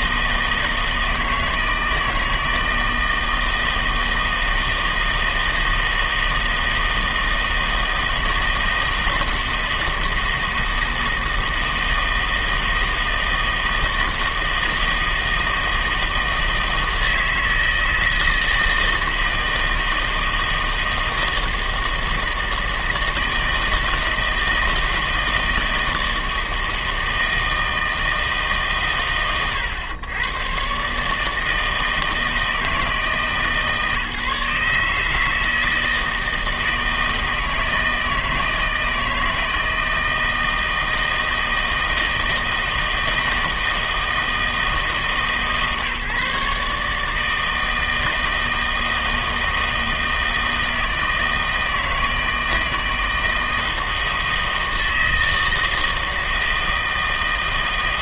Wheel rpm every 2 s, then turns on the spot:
160, 160, 160, 160, 160, 160, 160, 160, 160, 160, 160, 160, 160, 160, 150, 120, 160, 150, 160, 160, 160, 160, 160, 150, 160, 160, 160, 160, 160.
none